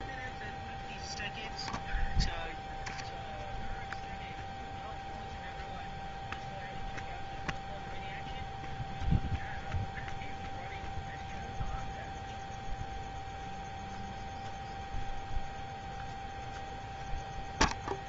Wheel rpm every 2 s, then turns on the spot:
0, 0, 0, 0, 0, 0, 0, 0, 0.
none